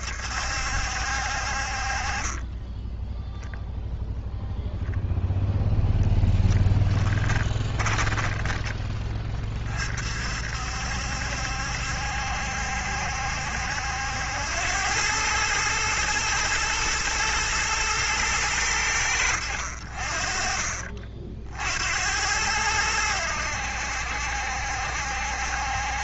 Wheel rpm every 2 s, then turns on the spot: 70, 20, 0, 10, 20, 60, 70, 90, 110, 100, 40, 90, 70.
none